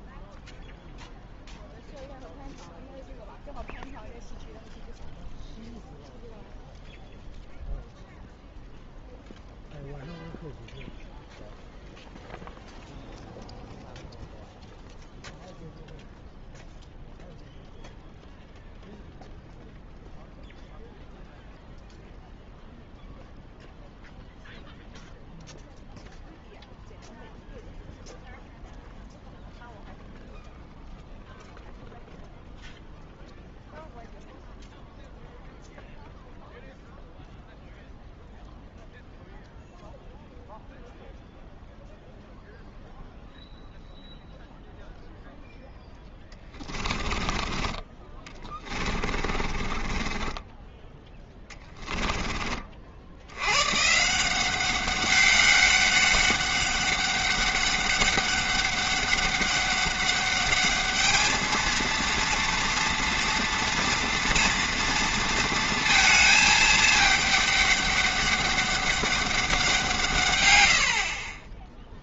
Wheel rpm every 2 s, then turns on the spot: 0, 0, 0, 0, 0, 0, 0, 0, 0, 0, 0, 0, 0, 0, 0, 0, 0, 0, 0, 0, 0, 0, 0, 20, 20, 10, 50, 190, 200, 200, 210, 230, 230, 220, 200, 90.
46-52